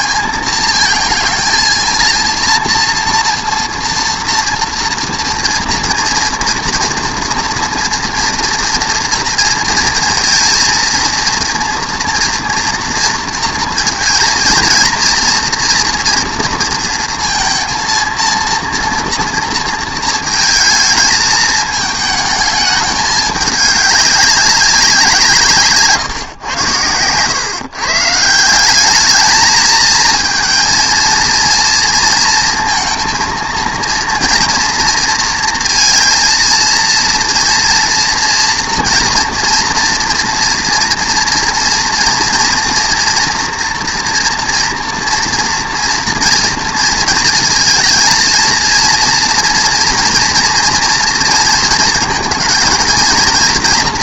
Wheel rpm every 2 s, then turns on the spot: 230, 230, 240, 230, 230, 230, 230, 230, 230, 230, 220, 220, 190, 110, 180, 220, 230, 240, 230, 230, 230, 230, 230, 230, 230, 230, 230.
none